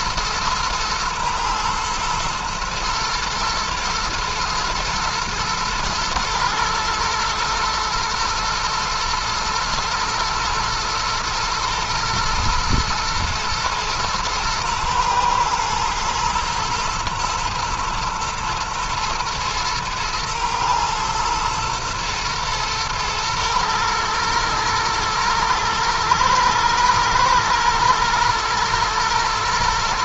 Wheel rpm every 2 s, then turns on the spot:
120, 120, 110, 110, 110, 110, 110, 120, 120, 120, 120, 110, 120, 120, 120.
none